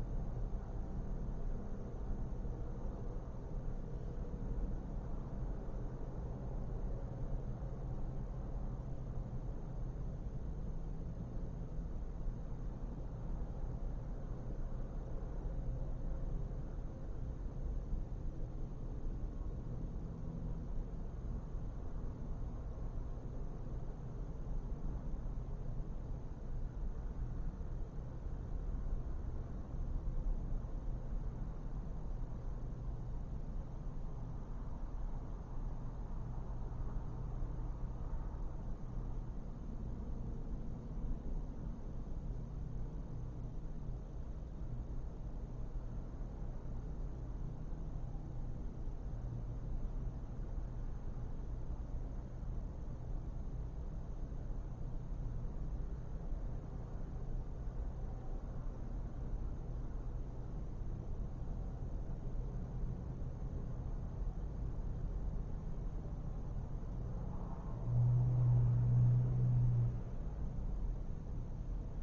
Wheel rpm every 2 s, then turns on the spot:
0, 0, 0, 0, 0, 0, 0, 0, 0, 0, 0, 0, 0, 0, 0, 0, 0, 0, 0, 0, 0, 0, 0, 0, 0, 0, 0, 0, 0, 0, 0, 0, 0, 0, 0, 0.
none